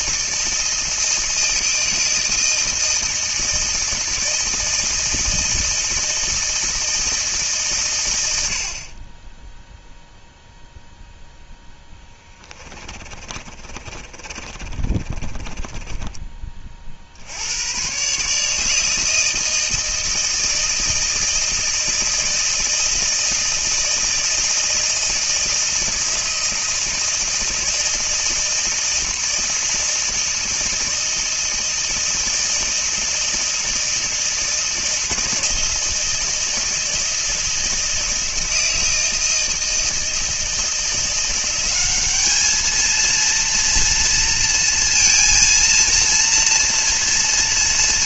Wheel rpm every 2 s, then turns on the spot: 160, 160, 160, 160, 50, 0, 30, 40, 50, 160, 160, 160, 160, 160, 160, 160, 160, 160, 160, 160, 170, 220, 230, 230.
12-16